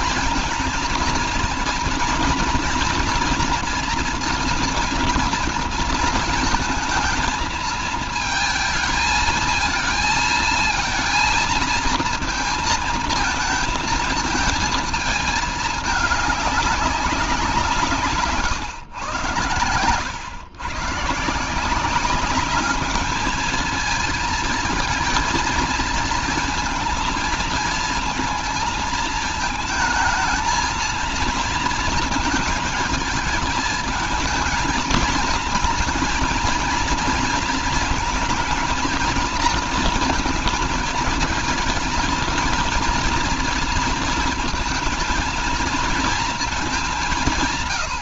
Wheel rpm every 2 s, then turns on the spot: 220, 230, 230, 230, 230, 230, 230, 220, 200, 130, 140, 210, 220, 230, 220, 220, 220, 220, 220, 230, 220, 230, 230, 200.
none